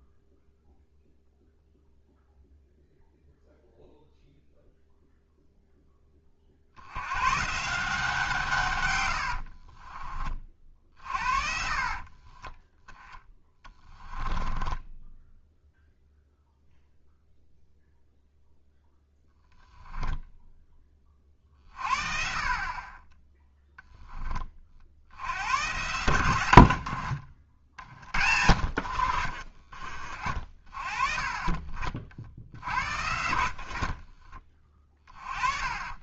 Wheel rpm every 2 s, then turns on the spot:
0, 0, 0, 70, 110, 50, 10, 10, 0, 0, 20, 30, 60, 70, 60, 30, 60, 20.
10-12 14-16 28-30